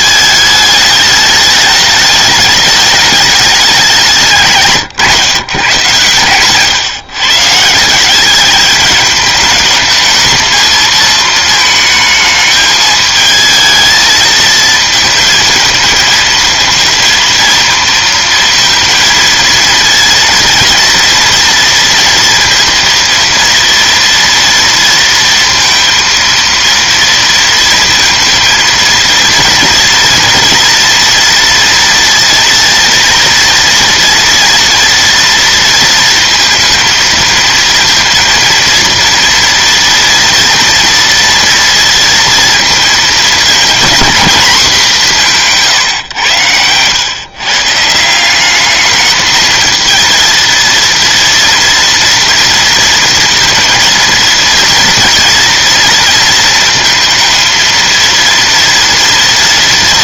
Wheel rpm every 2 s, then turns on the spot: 210, 210, 140, 130, 210, 220, 220, 220, 230, 230, 230, 230, 230, 230, 230, 230, 230, 230, 230, 230, 230, 230, 200, 110, 210, 230, 230, 230, 230, 230.
none